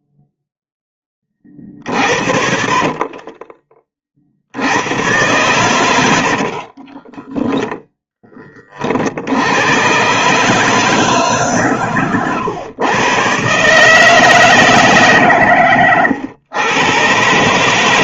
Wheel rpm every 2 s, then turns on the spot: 0, 50, 70, 50, 30, 150, 120, 160, 110.
2-4 6-8